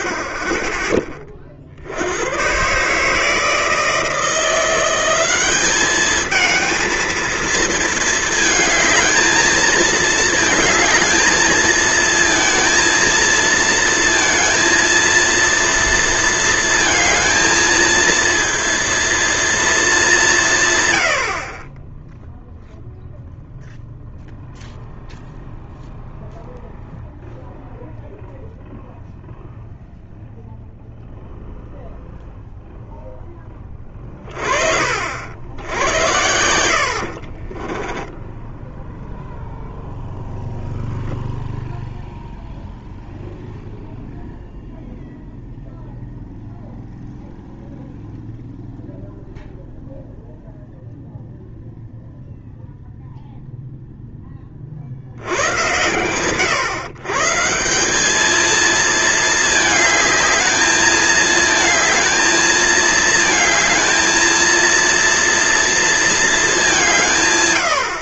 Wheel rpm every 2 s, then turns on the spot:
10, 110, 170, 220, 220, 220, 220, 230, 230, 230, 150, 0, 0, 0, 0, 0, 0, 30, 90, 10, 0, 0, 0, 0, 0, 0, 0, 30, 120, 220, 220, 220, 230, 200.
36-40